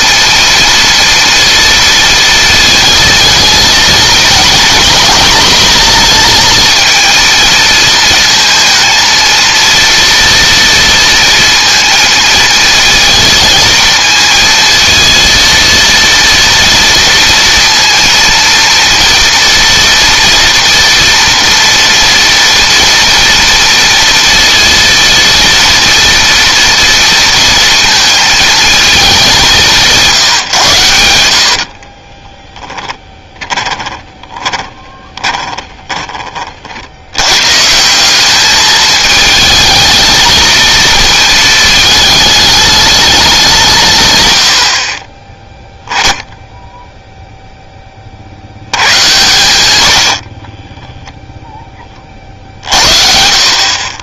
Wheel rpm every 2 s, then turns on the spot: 230, 230, 230, 230, 220, 230, 230, 230, 230, 230, 230, 230, 230, 230, 220, 110, 20, 20, 50, 210, 230, 210, 70, 0, 90, 20, 50.
32-36 50-52